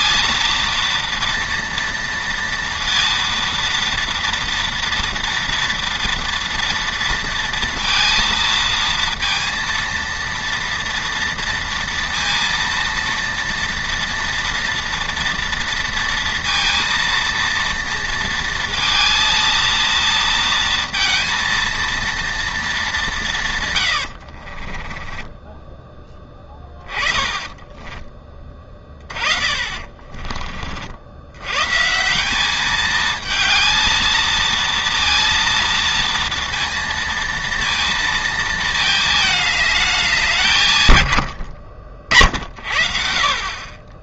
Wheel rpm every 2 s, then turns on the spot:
230, 230, 230, 230, 230, 230, 230, 230, 230, 230, 230, 150, 10, 20, 30, 110, 220, 230, 230, 220, 80, 40.
24-30